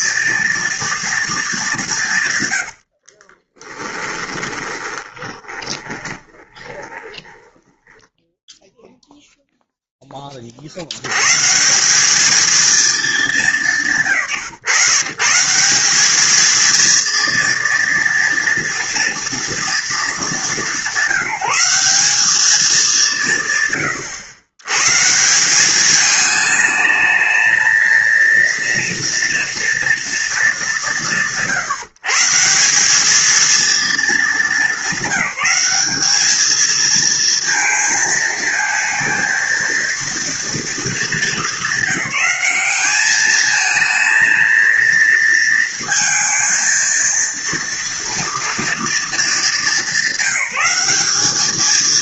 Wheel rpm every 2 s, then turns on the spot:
230, 100, 20, 20, 0, 50, 220, 130, 230, 240, 200, 200, 110, 220, 230, 170, 170, 220, 230, 230, 230, 210, 230, 230, 230, 210.
2-8